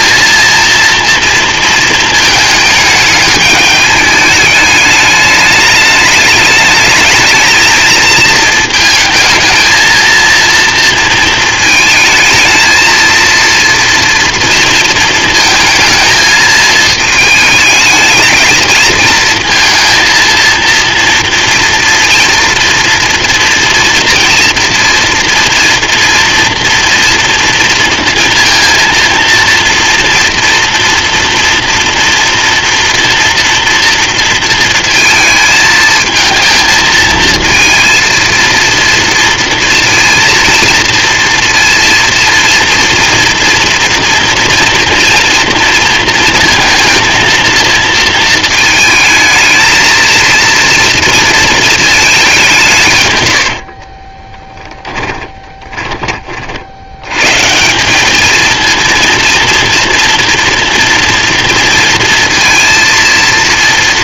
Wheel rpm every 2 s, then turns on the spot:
230, 220, 210, 220, 220, 230, 230, 230, 220, 220, 230, 230, 240, 230, 230, 230, 240, 230, 220, 230, 230, 230, 230, 230, 220, 230, 190, 10, 50, 230, 240, 230.
54-56